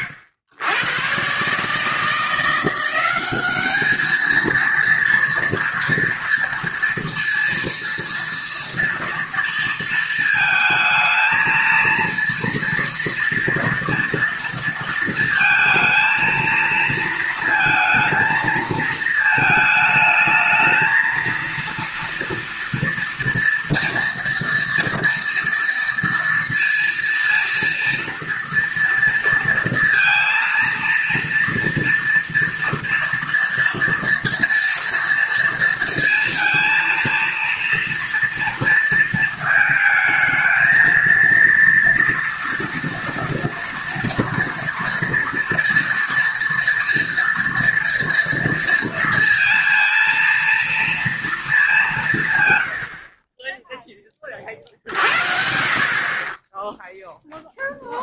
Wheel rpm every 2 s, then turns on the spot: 100, 170, 230, 230, 230, 220, 230, 230, 220, 230, 220, 240, 230, 230, 230, 230, 230, 230, 230, 230, 220, 230, 230, 230, 230, 230, 100, 50, 10.
none